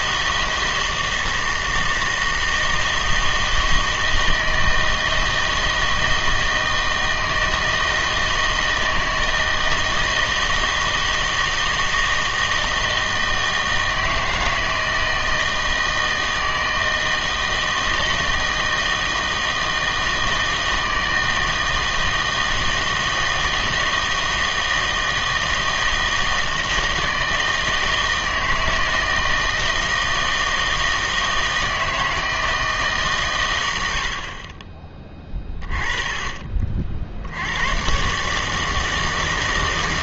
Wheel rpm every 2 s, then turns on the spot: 160, 160, 160, 160, 160, 160, 160, 160, 160, 160, 160, 160, 160, 160, 160, 160, 160, 20, 50, 160.
none